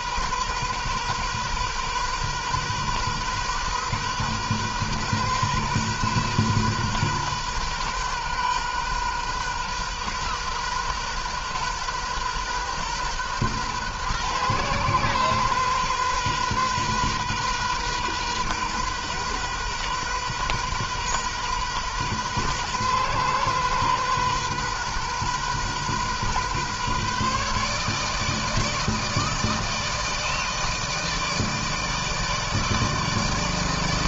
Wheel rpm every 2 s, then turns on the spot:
130, 130, 130, 130, 130, 130, 130, 120, 130, 130, 130, 130, 130, 130, 160, 160, 160.
none